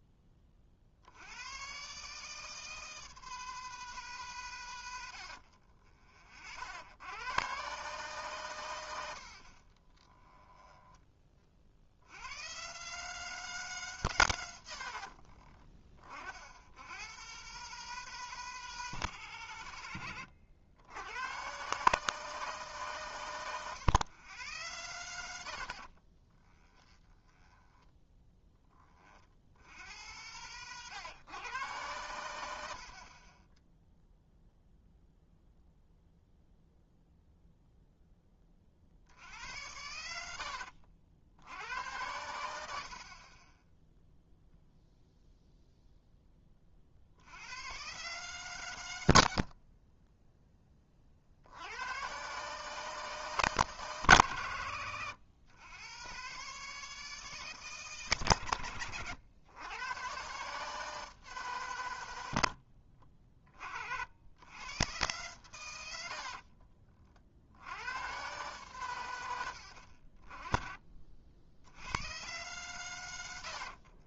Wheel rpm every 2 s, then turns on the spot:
40, 160, 120, 70, 110, 10, 120, 90, 80, 160, 90, 150, 100, 10, 20, 110, 90, 0, 0, 40, 70, 80, 0, 30, 130, 20, 150, 120, 150, 120, 150, 90, 100, 40, 130, 40, 110.
10-12 26-28 40-42 66-68